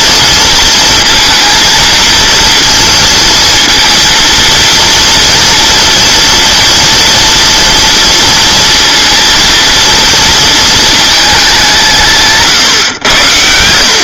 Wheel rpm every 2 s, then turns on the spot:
230, 230, 230, 230, 230, 230, 130.
none